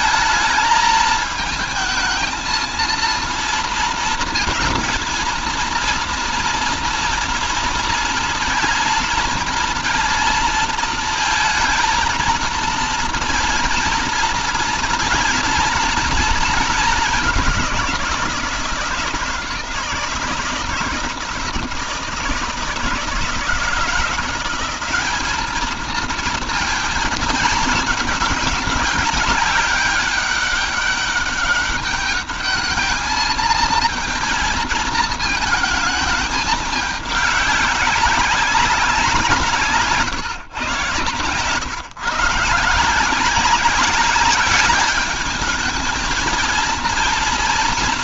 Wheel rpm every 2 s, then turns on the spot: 220, 230, 230, 230, 230, 230, 230, 230, 210, 160, 160, 160, 190, 220, 210, 200, 210, 220, 210, 180, 130, 160, 210, 230.
40-42